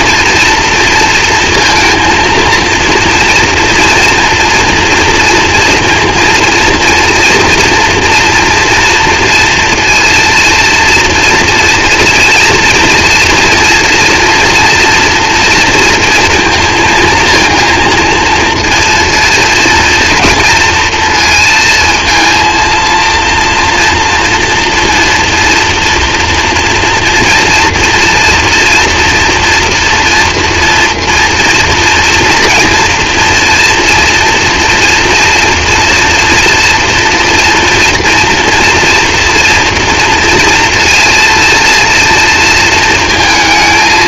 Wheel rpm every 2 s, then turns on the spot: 230, 230, 230, 230, 230, 230, 230, 240, 230, 230, 230, 230, 230, 230, 240, 240, 240, 230, 230, 240, 230, 230.
none